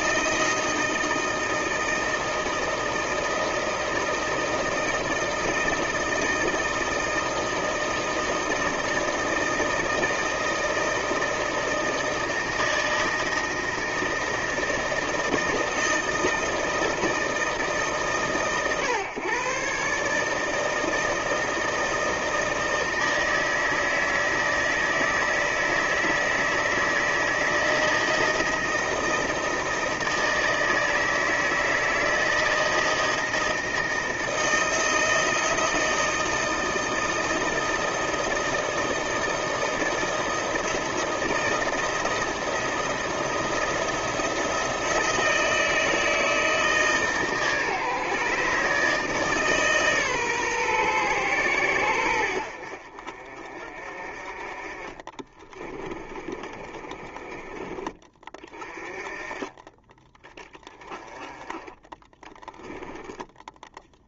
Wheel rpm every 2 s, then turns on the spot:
160, 160, 160, 160, 160, 160, 160, 160, 160, 130, 150, 160, 160, 160, 160, 160, 160, 160, 160, 170, 160, 170, 170, 160, 140, 140, 80, 40, 30, 20, 20, 10.
56-58 62-64